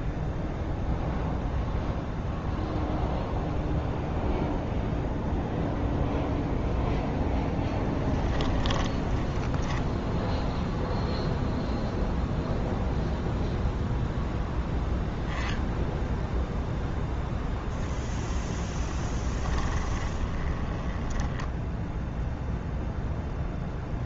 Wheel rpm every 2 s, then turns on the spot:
0, 0, 0, 0, 10, 0, 0, 0, 0, 20, 10, 0.
8-10 18-22